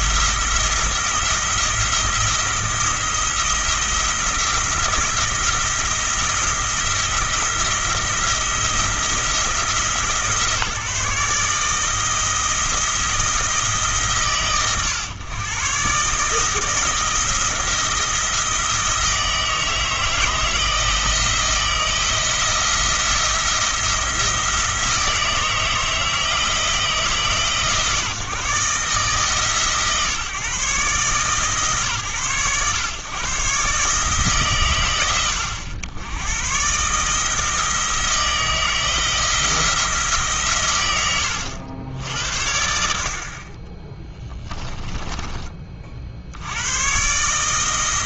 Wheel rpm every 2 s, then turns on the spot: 160, 170, 170, 170, 160, 150, 160, 110, 160, 160, 160, 170, 160, 160, 150, 140, 120, 100, 130, 160, 110, 70, 20, 110.
44-46